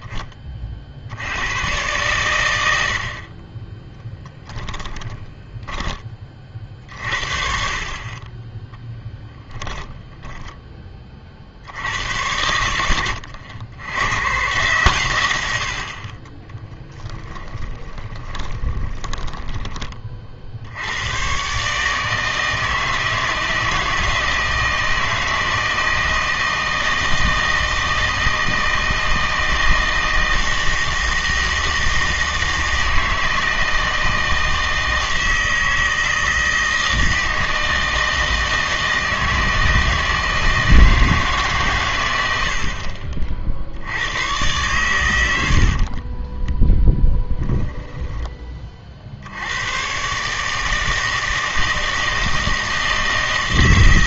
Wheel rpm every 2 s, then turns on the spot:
30, 90, 10, 50, 10, 10, 90, 120, 20, 30, 60, 160, 160, 160, 160, 160, 160, 160, 160, 160, 160, 70, 110, 10, 30, 160, 160.
4-6 16-20 46-48